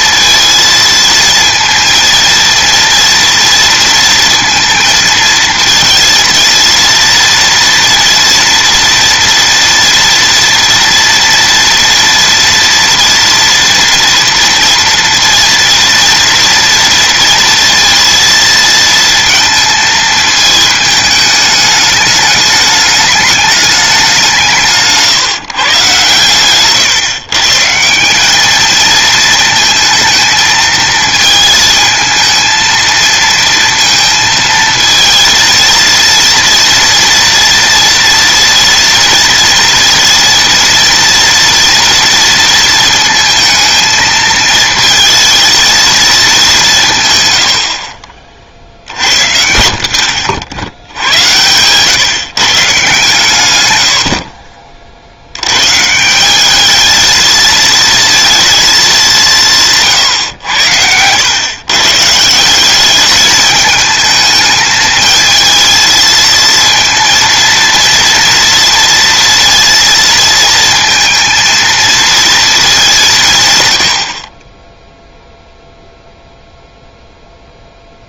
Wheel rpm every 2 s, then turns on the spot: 220, 230, 230, 230, 230, 230, 230, 230, 230, 230, 220, 210, 170, 140, 220, 220, 230, 230, 240, 230, 230, 230, 220, 160, 70, 80, 140, 50, 220, 210, 100, 200, 220, 230, 230, 230, 180, 0, 0.
none